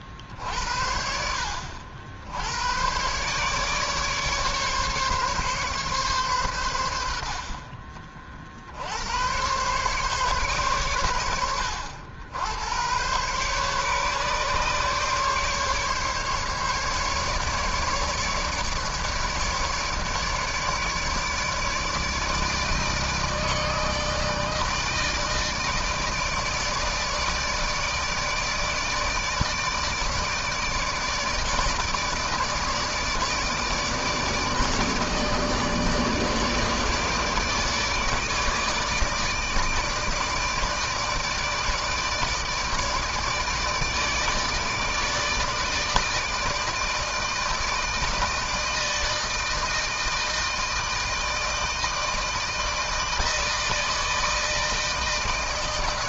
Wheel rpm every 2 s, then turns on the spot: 60, 90, 140, 100, 60, 130, 100, 140, 140, 150, 150, 160, 160, 150, 160, 150, 150, 150, 150, 160, 160, 160, 150, 160, 160, 160, 160, 160.
none